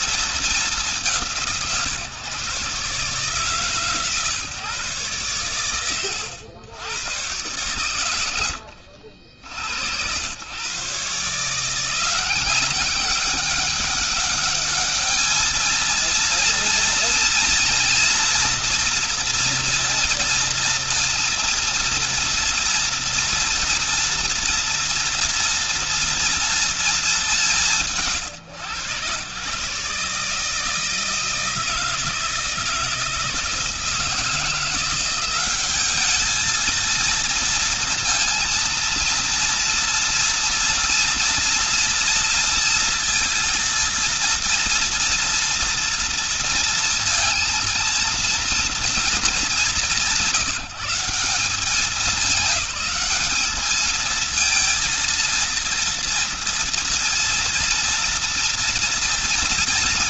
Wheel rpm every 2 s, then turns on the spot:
200, 130, 140, 100, 80, 110, 190, 210, 230, 240, 230, 230, 230, 230, 140, 150, 160, 170, 220, 230, 230, 230, 230, 230, 230, 180, 210, 220, 230, 230.
none